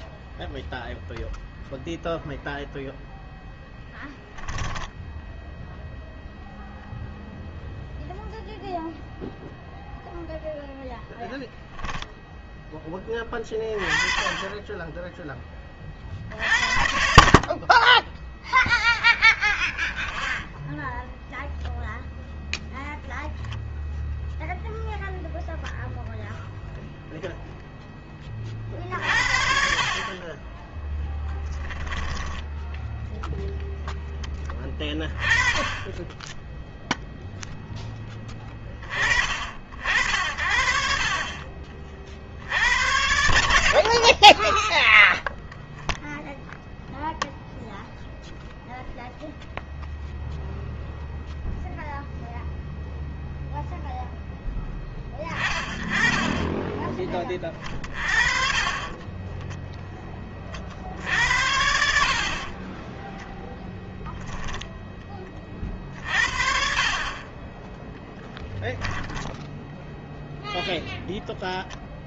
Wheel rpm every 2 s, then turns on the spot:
0, 0, 10, 0, 0, 0, 0, 20, 50, 10, 0, 0, 0, 0, 30, 30, 10, 10, 10, 10, 60, 70, 30, 0, 0, 0, 0, 0, 20, 50, 30, 40, 0, 50, 10, 0.
4-6 30-32 58-60 62-64